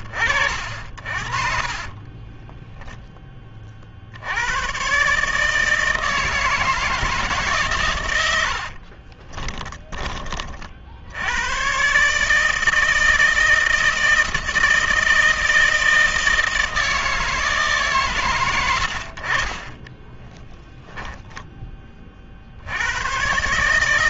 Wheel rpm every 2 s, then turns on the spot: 50, 10, 140, 160, 40, 50, 160, 160, 160, 90, 10, 50.
8-10